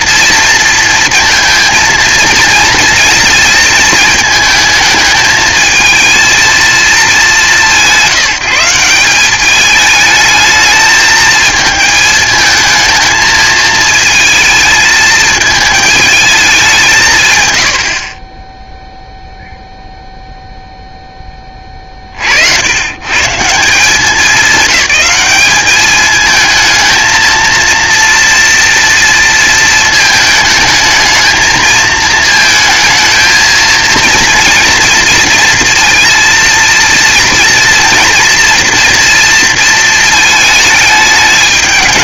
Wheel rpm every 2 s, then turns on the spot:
230, 230, 220, 220, 180, 220, 220, 220, 170, 0, 0, 100, 200, 220, 230, 220, 220, 230, 230, 230, 210.
none